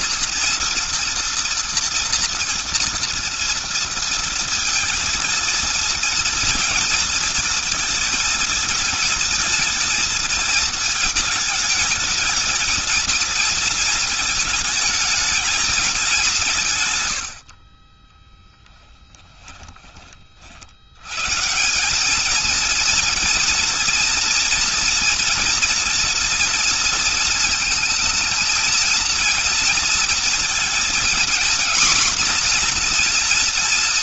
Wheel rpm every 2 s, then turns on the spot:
240, 230, 230, 220, 220, 220, 220, 220, 160, 10, 60, 220, 240, 230, 220, 230, 250.
18-20